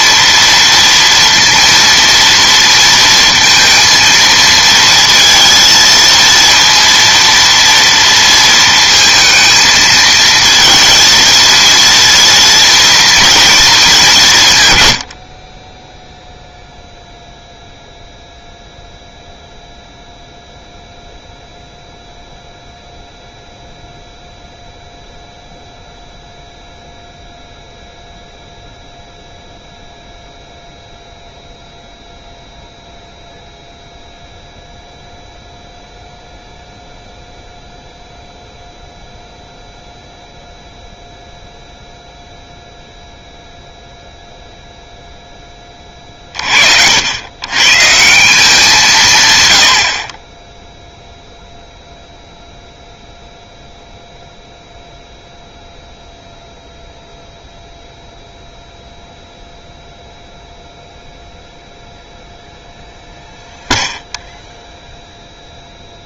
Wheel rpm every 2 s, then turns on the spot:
230, 230, 230, 230, 230, 230, 230, 130, 0, 0, 0, 0, 0, 0, 0, 0, 0, 0, 0, 0, 0, 0, 0, 60, 170, 0, 0, 0, 0, 0, 0, 0, 0.
none